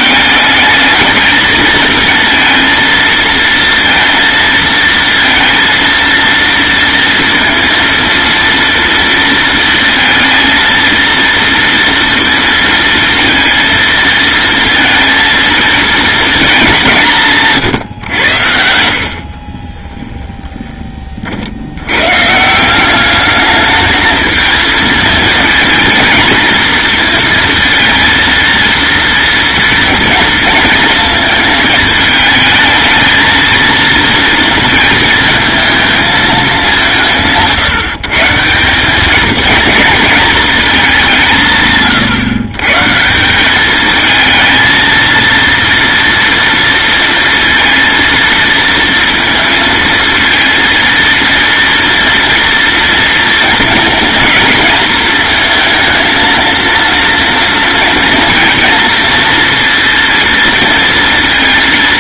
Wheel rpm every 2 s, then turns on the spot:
220, 230, 220, 230, 230, 230, 230, 230, 190, 60, 30, 180, 220, 230, 230, 230, 220, 230, 180, 190, 200, 150, 230, 230, 230, 230, 230, 230, 230, 230, 230.
none